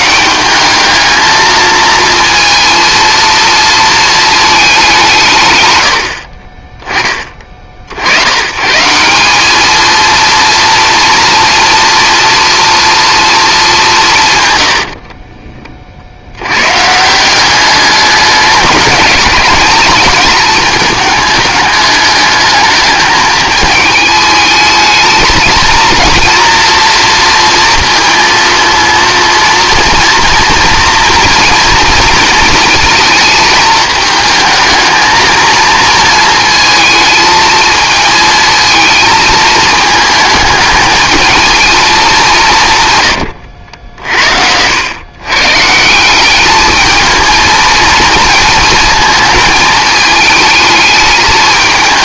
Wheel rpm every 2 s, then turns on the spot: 190, 230, 220, 40, 130, 230, 230, 110, 110, 210, 220, 210, 210, 230, 230, 230, 230, 220, 230, 220, 220, 150, 80, 210, 230, 220.
14-16